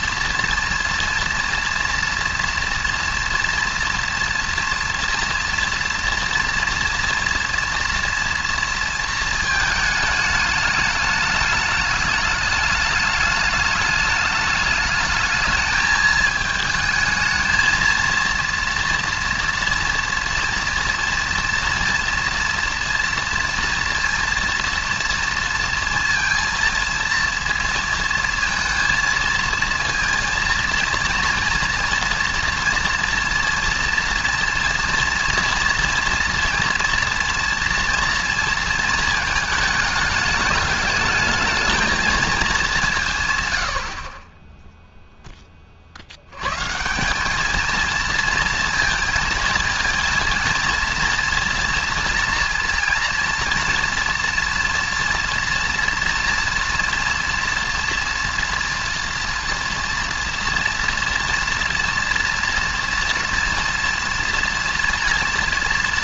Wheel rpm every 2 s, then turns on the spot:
240, 230, 230, 230, 230, 210, 210, 220, 220, 230, 230, 230, 230, 230, 230, 230, 240, 230, 230, 230, 210, 200, 0, 150, 230, 230, 230, 230, 230, 230, 230, 230, 230.
none